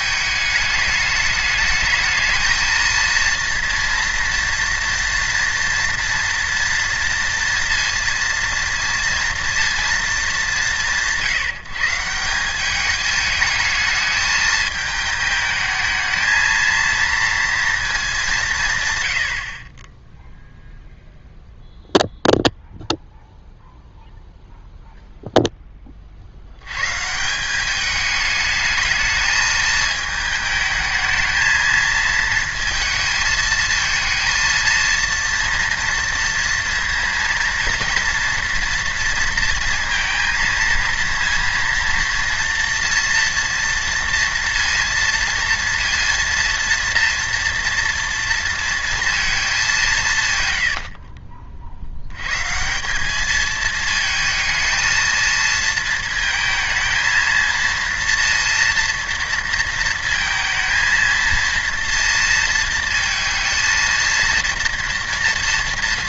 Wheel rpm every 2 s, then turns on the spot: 210, 220, 240, 240, 230, 170, 210, 220, 230, 150, 0, 0, 0, 100, 210, 220, 220, 230, 230, 230, 230, 230, 230, 230, 230, 100, 160, 230, 220, 230, 230, 230, 230.
50-52